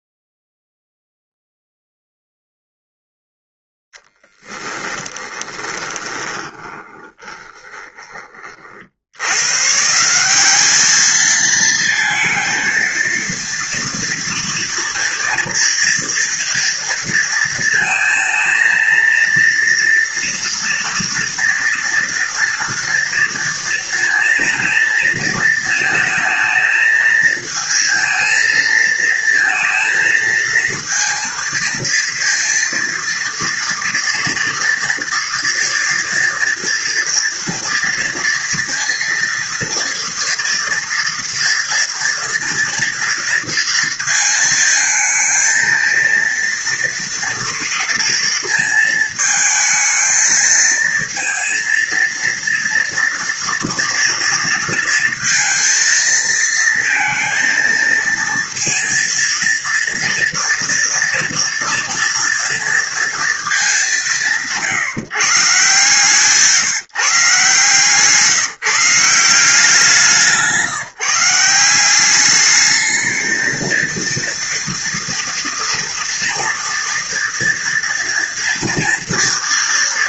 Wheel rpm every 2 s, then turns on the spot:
0, 0, 20, 20, 90, 220, 230, 230, 230, 230, 230, 230, 230, 220, 230, 230, 230, 230, 240, 230, 230, 230, 220, 230, 220, 230, 230, 230, 230, 230, 240, 210, 140, 140, 170, 170, 220, 230, 230, 230.
4-8